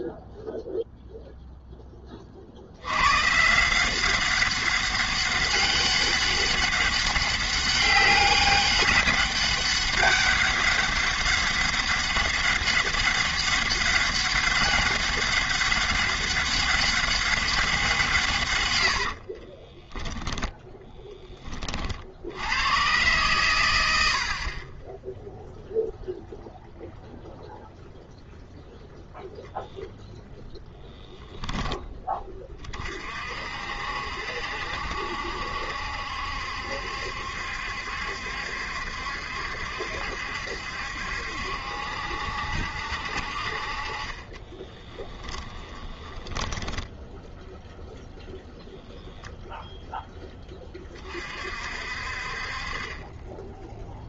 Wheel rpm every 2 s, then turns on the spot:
0, 90, 200, 200, 190, 200, 200, 200, 200, 140, 20, 120, 10, 0, 0, 10, 40, 70, 70, 70, 70, 60, 20, 10, 0, 30, 30.
18-20 44-48